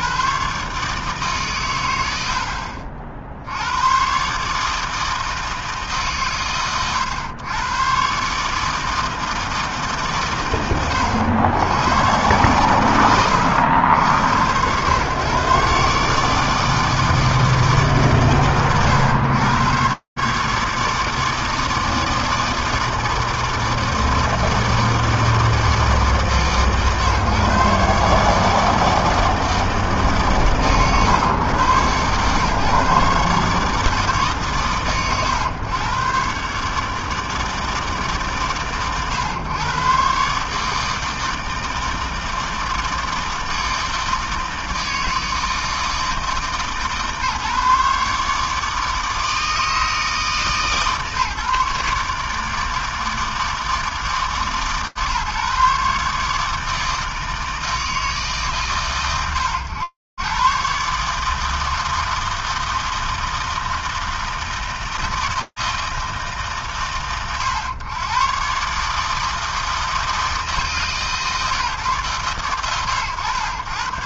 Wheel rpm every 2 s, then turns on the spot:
70, 90, 110, 150, 110, 150, 120, 110, 140, 150, 120, 160, 160, 160, 140, 150, 120, 150, 110, 150, 120, 160, 160, 160, 150, 160, 140, 160, 140, 160, 120, 160, 160, 160, 120, 160, 130.
none